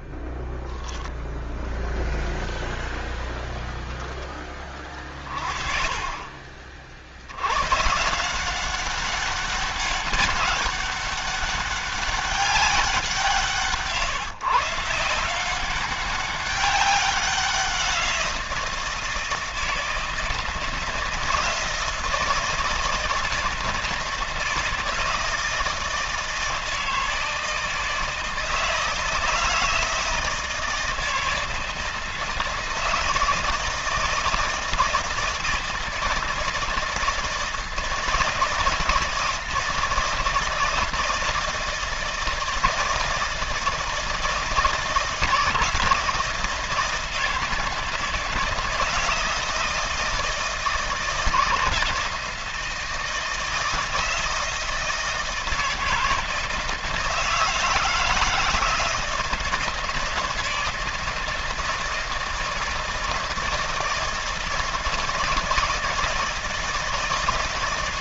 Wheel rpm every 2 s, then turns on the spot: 10, 0, 20, 60, 190, 200, 180, 170, 190, 160, 160, 160, 160, 160, 160, 160, 160, 160, 160, 160, 160, 160, 160, 170, 160, 160, 160, 160, 160, 160, 160, 160, 160, 160.
none